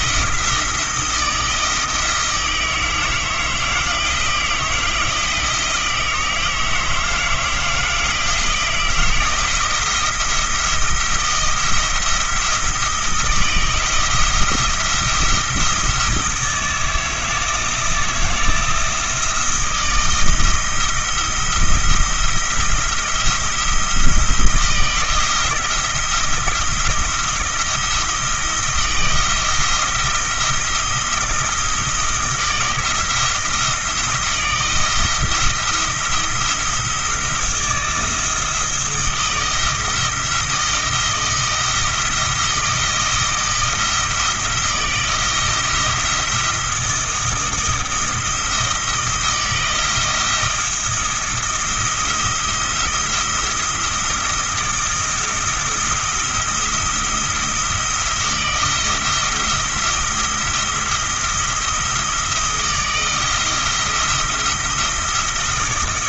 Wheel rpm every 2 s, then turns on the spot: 170, 160, 160, 160, 160, 170, 160, 170, 160, 170, 160, 170, 170, 170, 170, 170, 160, 160, 170, 160, 160, 170, 160, 160, 170, 170, 170, 170, 170, 170, 170, 160, 170.
none